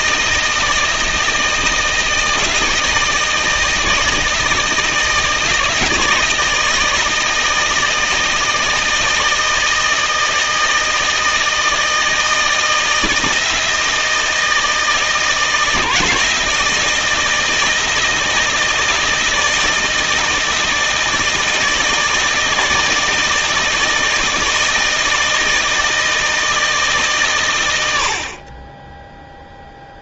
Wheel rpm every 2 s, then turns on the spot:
170, 160, 160, 160, 160, 160, 160, 160, 160, 160, 160, 160, 160, 160, 20.
none